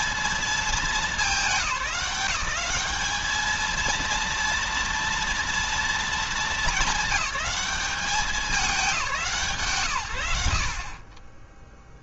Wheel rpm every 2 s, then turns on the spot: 220, 190, 230, 210, 200, 90.
none